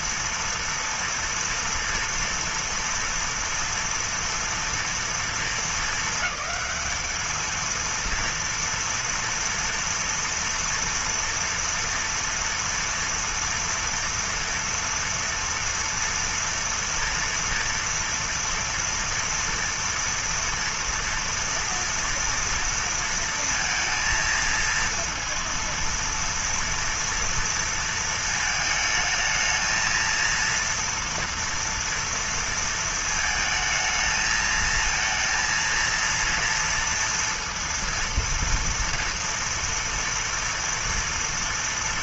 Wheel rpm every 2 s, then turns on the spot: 230, 230, 230, 210, 230, 230, 230, 230, 230, 230, 230, 230, 230, 230, 220, 230, 230, 220, 230, 230, 230.
none